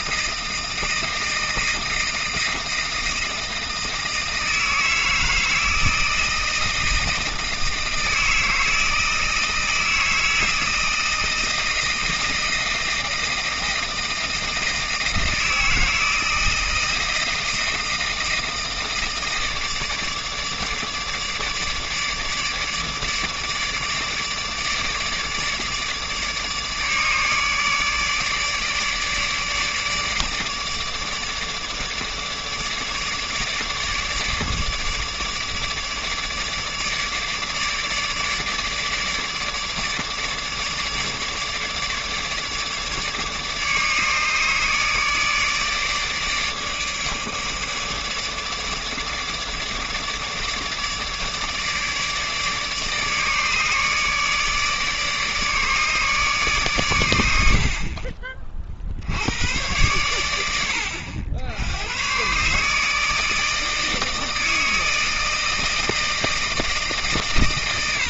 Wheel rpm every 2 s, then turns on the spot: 160, 160, 160, 160, 160, 160, 160, 160, 160, 160, 150, 150, 150, 150, 150, 150, 150, 150, 150, 150, 150, 150, 150, 150, 150, 150, 150, 150, 130, 40, 80, 140, 160, 160.
none